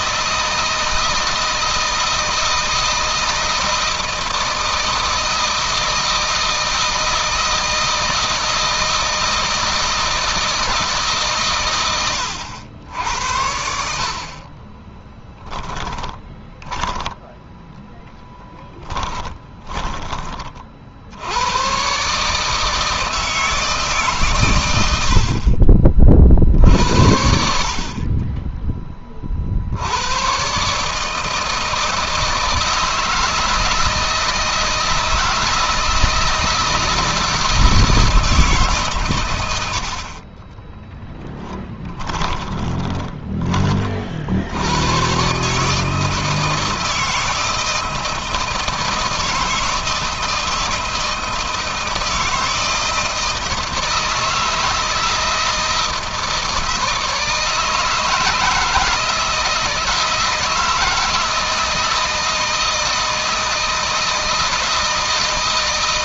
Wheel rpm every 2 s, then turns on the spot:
160, 160, 160, 160, 160, 160, 90, 30, 10, 10, 40, 150, 120, 60, 20, 140, 160, 160, 160, 140, 30, 20, 90, 160, 160, 160, 160, 160, 160, 160, 160, 160, 160.
14-20 40-44